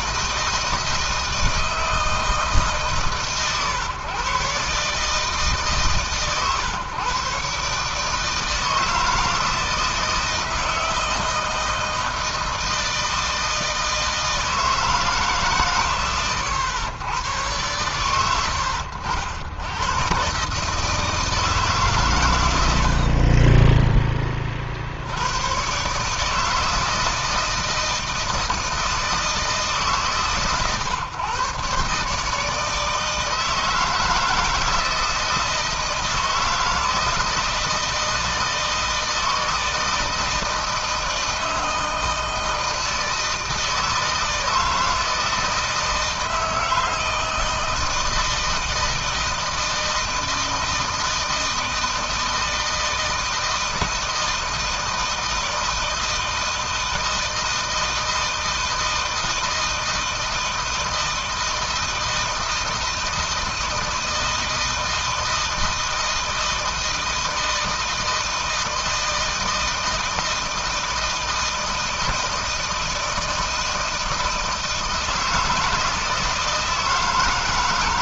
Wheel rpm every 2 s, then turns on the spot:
160, 160, 140, 130, 160, 160, 160, 160, 110, 80, 130, 100, 30, 150, 160, 130, 150, 160, 160, 160, 160, 160, 160, 160, 160, 160, 160, 160, 160, 160, 160, 160, 160, 160, 160, 160, 160, 160, 160.
none